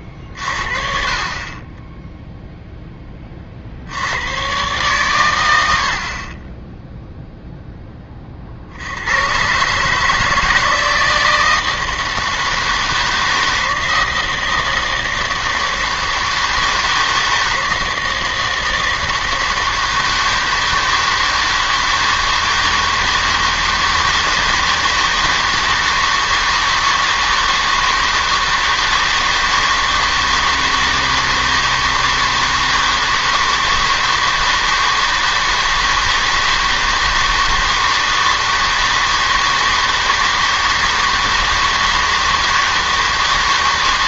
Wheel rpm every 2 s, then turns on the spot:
50, 0, 130, 20, 60, 160, 160, 160, 160, 160, 160, 160, 160, 160, 160, 160, 160, 160, 160, 160, 160, 160.
none